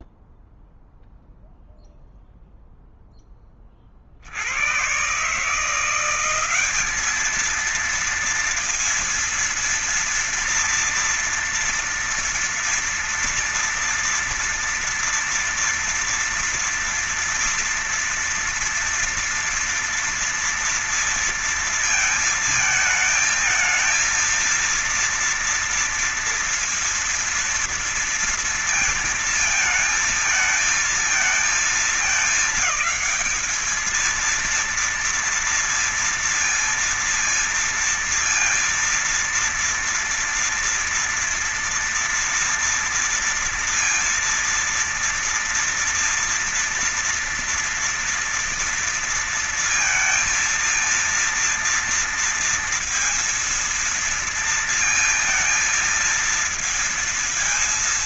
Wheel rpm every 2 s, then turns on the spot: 0, 0, 60, 180, 230, 230, 230, 230, 230, 230, 230, 220, 230, 230, 230, 220, 220, 230, 230, 230, 230, 230, 230, 240, 230, 230, 230, 230, 230.
none